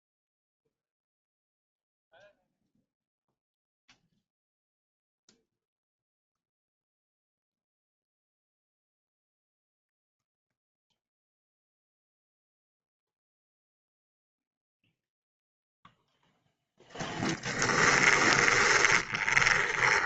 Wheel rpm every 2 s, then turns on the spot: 0, 0, 0, 0, 0, 0, 0, 0, 0, 20.
18-20